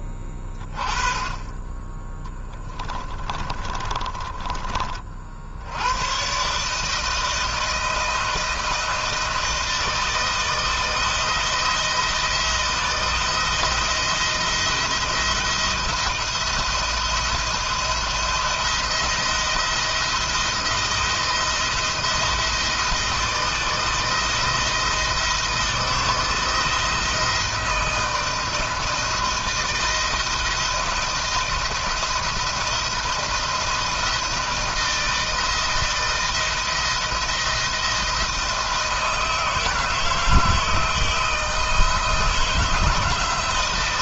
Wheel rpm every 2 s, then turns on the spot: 10, 10, 30, 130, 160, 160, 160, 170, 170, 170, 160, 160, 160, 160, 160, 160, 170, 170, 170, 160, 160, 160.
2-4